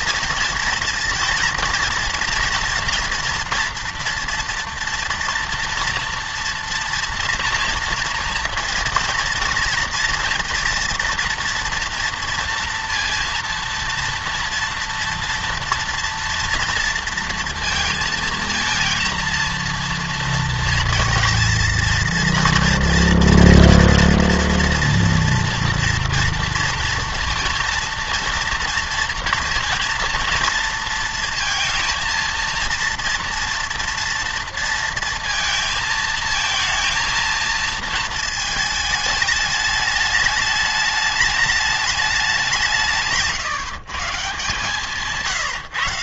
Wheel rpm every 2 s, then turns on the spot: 230, 230, 230, 230, 230, 230, 230, 230, 230, 230, 230, 230, 230, 230, 230, 230, 230, 230, 230, 220, 210, 170, 160.
none